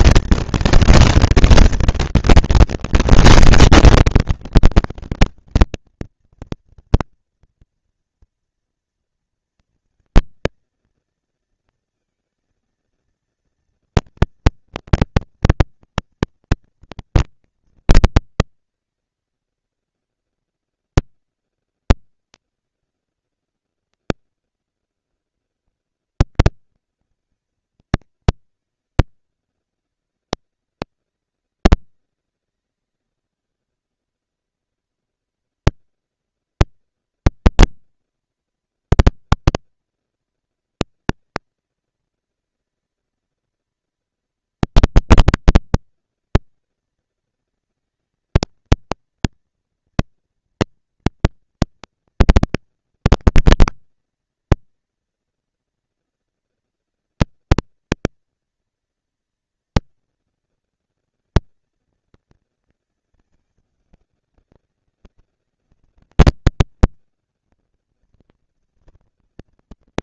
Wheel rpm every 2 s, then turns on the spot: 230, 230, 230, 230, 230, 230, 220, 230, 230, 230, 230, 230, 230, 230, 220, 200, 190, 220, 230, 230, 230, 230, 230, 230, 230, 240, 230, 230, 230, 240, 230, 230, 200, 200, 220.
none